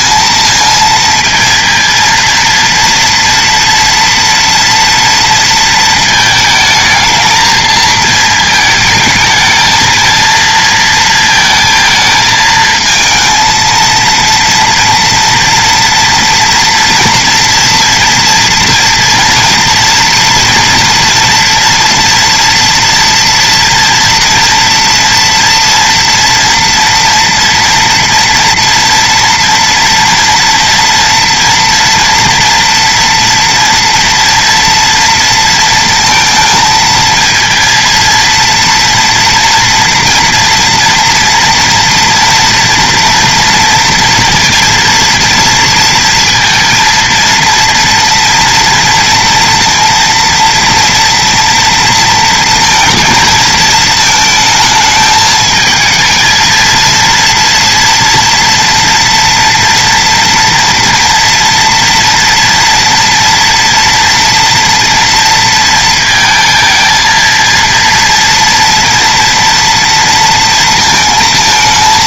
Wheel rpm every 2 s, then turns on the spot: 230, 230, 230, 220, 220, 220, 220, 230, 240, 240, 230, 230, 230, 240, 230, 230, 240, 240, 230, 230, 230, 230, 230, 230, 230, 230, 230, 220, 230, 230, 230, 230, 230, 230, 230, 230.
none